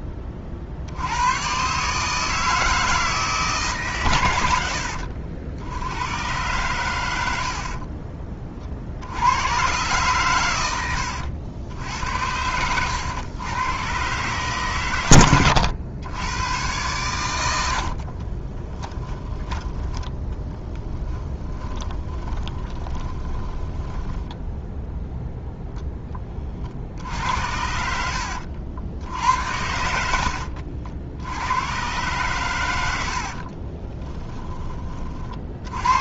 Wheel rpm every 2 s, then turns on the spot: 50, 160, 80, 110, 50, 100, 100, 130, 110, 20, 20, 20, 0, 50, 80, 70, 100, 20.
18-24